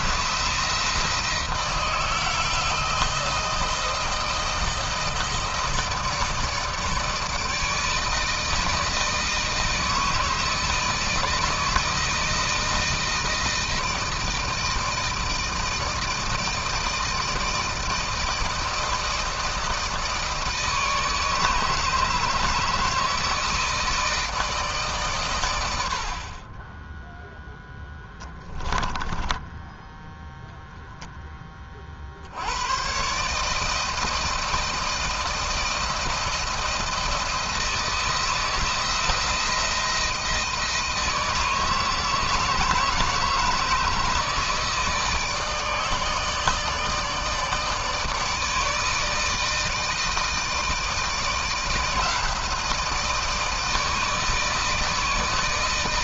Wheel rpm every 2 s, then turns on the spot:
170, 160, 160, 160, 160, 160, 160, 160, 160, 160, 160, 160, 160, 40, 10, 0, 80, 160, 170, 170, 160, 160, 160, 160, 150, 160, 160, 160.
28-30